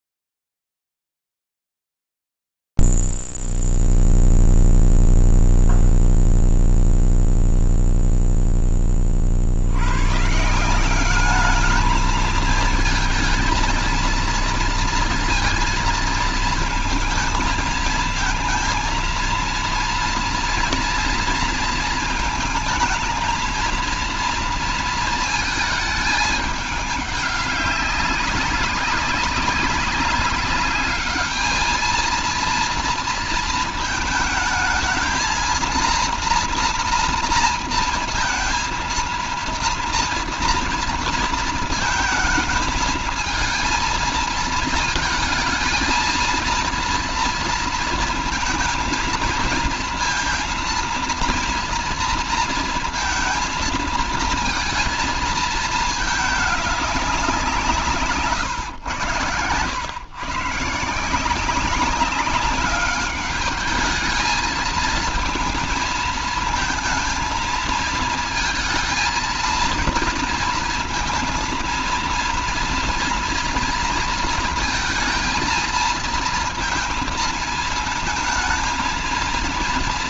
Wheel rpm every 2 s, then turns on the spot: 0, 0, 0, 0, 0, 100, 210, 230, 230, 220, 230, 230, 230, 220, 200, 190, 220, 220, 230, 230, 230, 230, 230, 230, 230, 230, 230, 230, 210, 120, 140, 200, 220, 230, 230, 230, 230, 230, 230, 220.
none